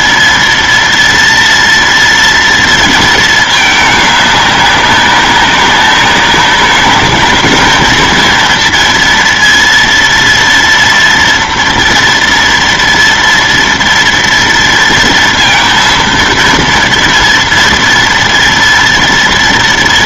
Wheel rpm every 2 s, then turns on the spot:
230, 230, 200, 200, 230, 230, 230, 230, 230, 230.
none